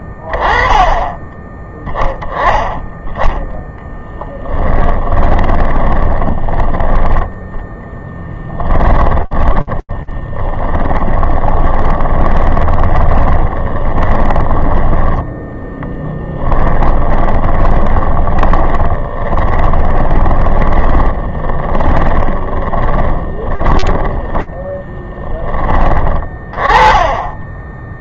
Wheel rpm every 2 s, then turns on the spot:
30, 10, 10, 10, 20, 40, 20, 20, 20, 30, 20, 20, 10, 20.
4-24